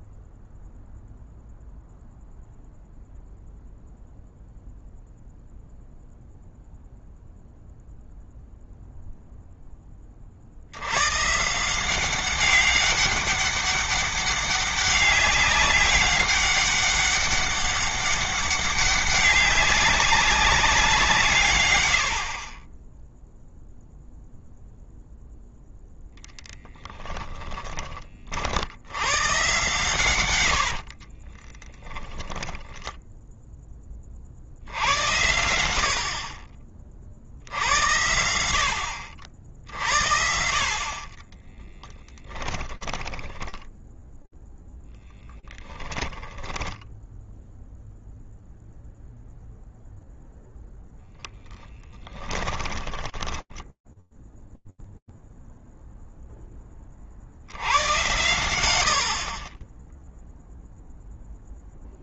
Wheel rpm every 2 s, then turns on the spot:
0, 0, 0, 0, 0, 60, 190, 200, 200, 200, 190, 40, 0, 0, 60, 100, 20, 60, 40, 70, 60, 20, 0, 10, 0, 10, 10, 0, 60, 50, 0.
30-34 42-44 52-54